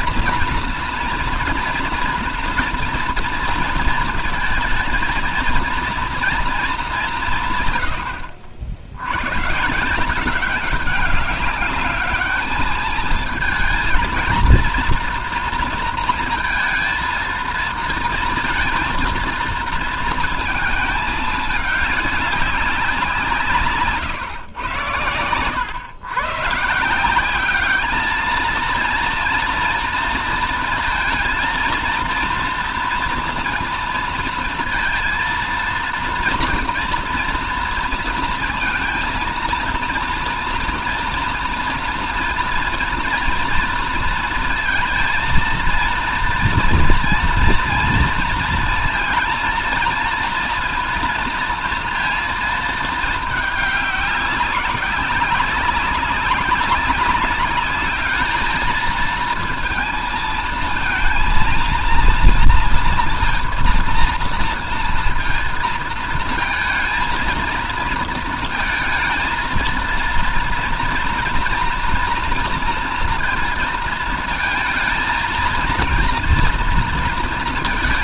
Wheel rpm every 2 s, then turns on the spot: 230, 230, 230, 220, 70, 190, 210, 230, 230, 230, 220, 190, 110, 150, 230, 230, 230, 230, 230, 220, 230, 230, 230, 230, 230, 230, 220, 200, 200, 220, 230, 230, 230, 230, 230, 230, 230, 220, 230.
none